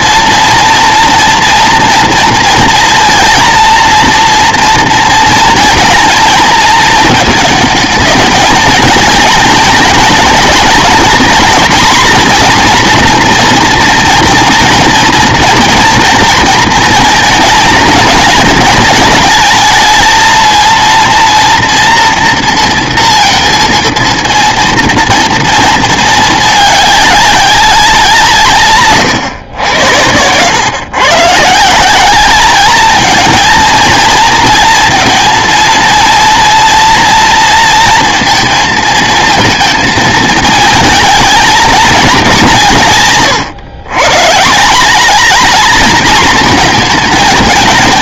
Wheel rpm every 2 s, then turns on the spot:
230, 230, 230, 220, 220, 230, 230, 230, 230, 220, 230, 230, 230, 210, 130, 110, 220, 230, 230, 230, 220, 180, 180, 230.
28-30